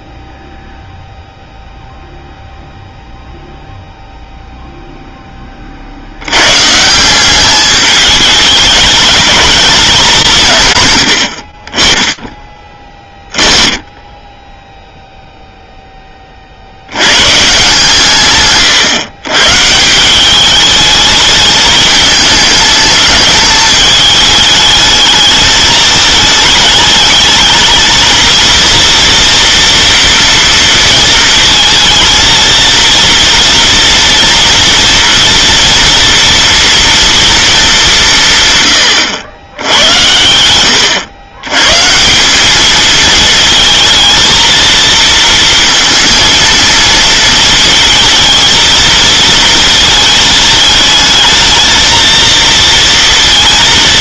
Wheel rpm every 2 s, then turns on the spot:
0, 0, 0, 140, 210, 150, 20, 0, 60, 130, 210, 210, 220, 210, 230, 230, 230, 230, 230, 130, 100, 210, 230, 230, 230, 220, 230.
none